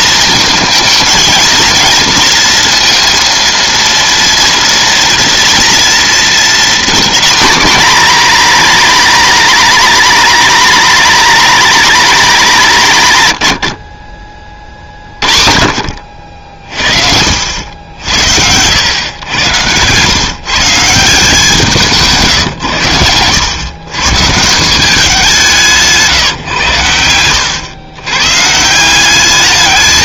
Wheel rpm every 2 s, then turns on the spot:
230, 230, 230, 230, 240, 220, 200, 40, 50, 100, 160, 120, 160, 120, 150.
none